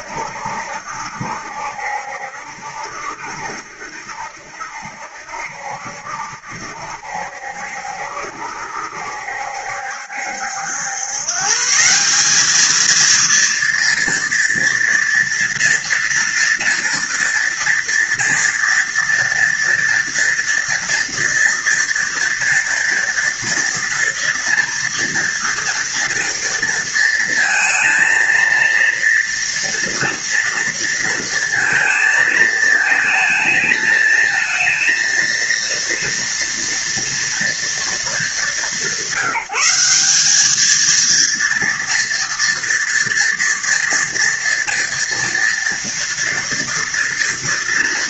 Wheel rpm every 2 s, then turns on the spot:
70, 70, 70, 70, 70, 110, 230, 230, 240, 230, 230, 230, 240, 230, 230, 230, 220, 230, 230, 190, 230, 230, 230, 230.
none